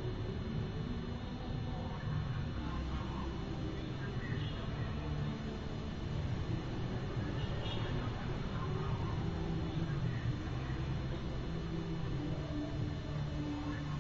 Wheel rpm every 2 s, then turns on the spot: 0, 0, 0, 0, 0, 0, 0.
none